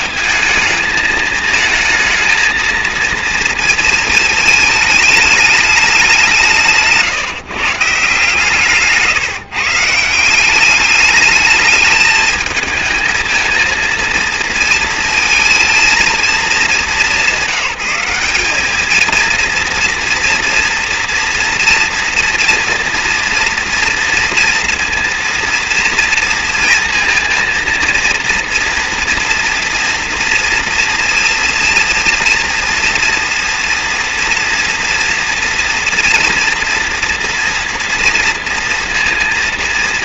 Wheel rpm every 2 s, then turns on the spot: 220, 230, 210, 150, 150, 200, 220, 230, 210, 220, 230, 240, 240, 230, 230, 230, 230, 240, 240, 230.
6-10